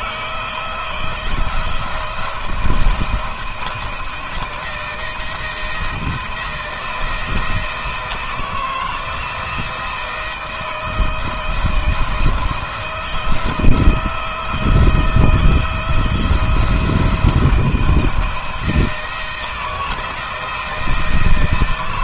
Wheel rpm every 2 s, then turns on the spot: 160, 170, 170, 170, 160, 160, 160, 160, 170, 170, 160.
none